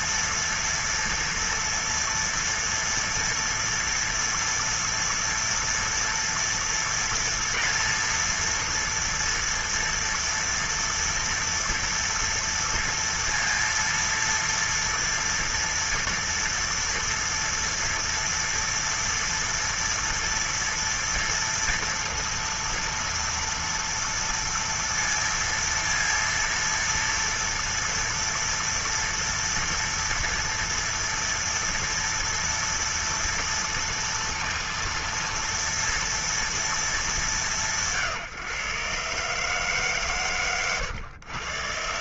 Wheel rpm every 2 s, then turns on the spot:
230, 230, 230, 230, 230, 230, 230, 230, 230, 240, 240, 230, 230, 230, 230, 230, 230, 230, 230, 150, 140.
none